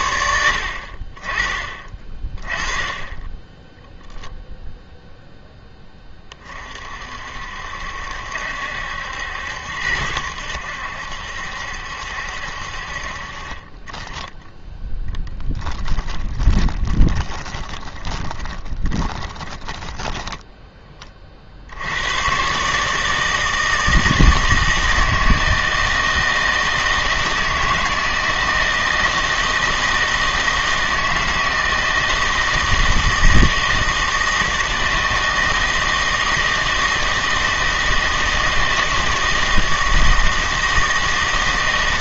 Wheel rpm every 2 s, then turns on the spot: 60, 20, 0, 40, 70, 80, 60, 10, 20, 20, 20, 150, 160, 160, 160, 160, 160, 160, 160, 160, 160.
14-20